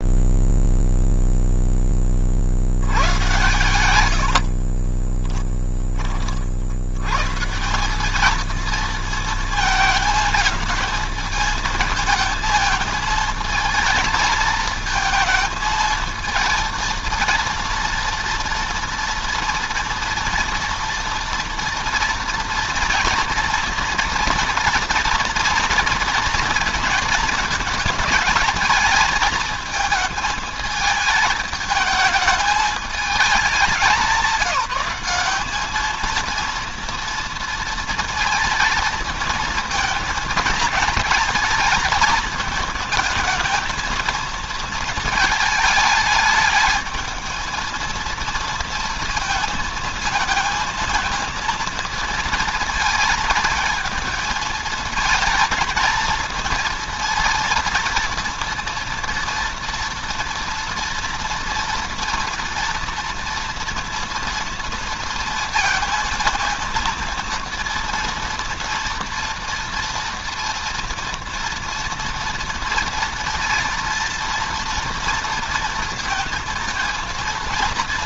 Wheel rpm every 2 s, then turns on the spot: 0, 100, 30, 120, 230, 220, 220, 220, 230, 230, 230, 230, 230, 230, 220, 220, 210, 200, 230, 230, 230, 220, 220, 220, 230, 230, 230, 220, 230, 230, 230, 230, 230, 230, 230, 240, 230, 230, 230.
4-6